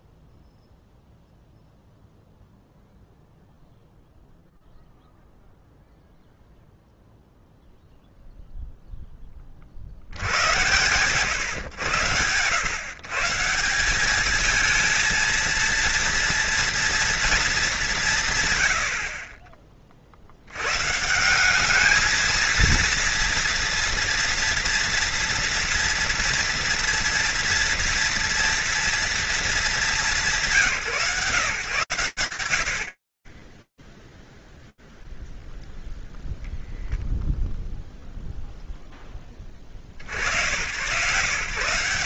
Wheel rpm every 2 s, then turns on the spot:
0, 0, 0, 0, 10, 120, 130, 220, 230, 70, 120, 230, 230, 230, 240, 160, 20, 0, 0, 10, 130.
32-34